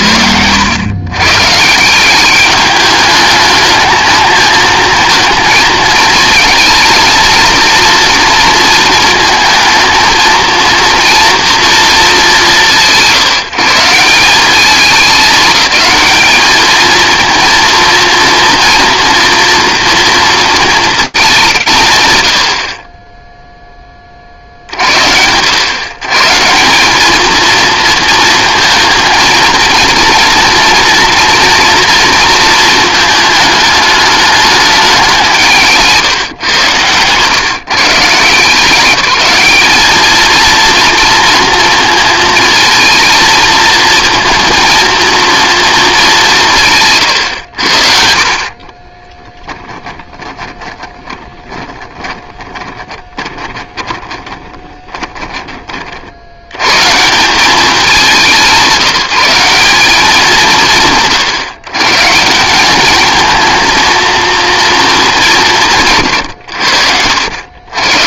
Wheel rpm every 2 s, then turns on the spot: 100, 210, 220, 220, 230, 230, 140, 200, 220, 230, 220, 50, 70, 180, 230, 230, 230, 210, 120, 180, 230, 230, 220, 160, 30, 20, 20, 10, 190, 160, 120, 220, 200, 80.
48-56